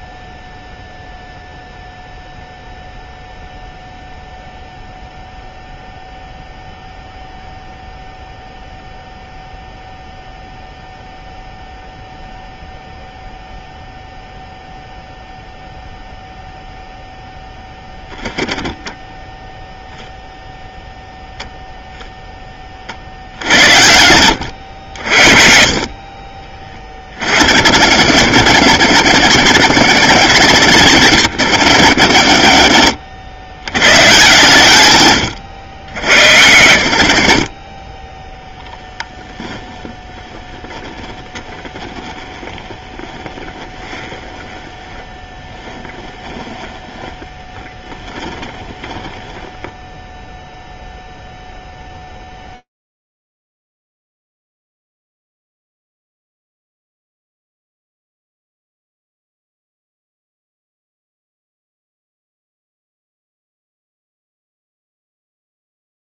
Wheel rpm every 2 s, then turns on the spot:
0, 0, 0, 0, 0, 0, 0, 0, 0, 0, 0, 40, 70, 30, 90, 90, 60, 110, 90, 0, 10, 20, 20, 10, 10, 0, 0, 0, 0, 0, 0, 0, 0.
32-34 42-48